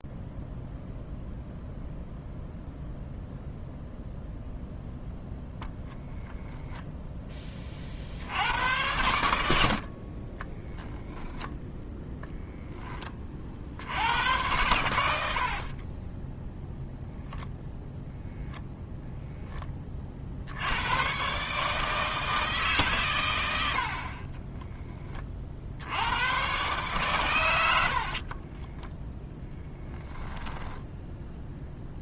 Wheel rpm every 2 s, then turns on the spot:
0, 0, 0, 0, 90, 10, 20, 100, 0, 0, 100, 130, 10, 130, 20, 10.
10-12 28-32